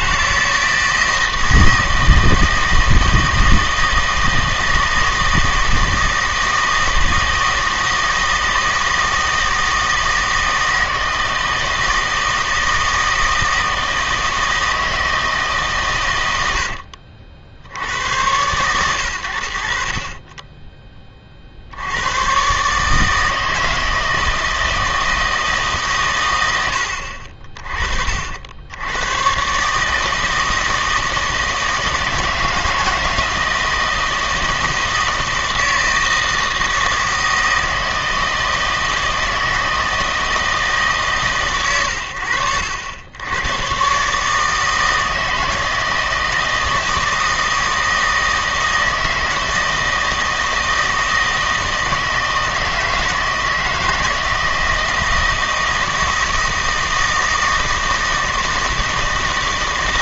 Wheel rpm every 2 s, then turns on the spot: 160, 160, 160, 160, 160, 160, 160, 160, 70, 90, 20, 150, 160, 80, 100, 160, 160, 160, 160, 160, 150, 80, 160, 160, 160, 160, 160, 160, 160, 160.
none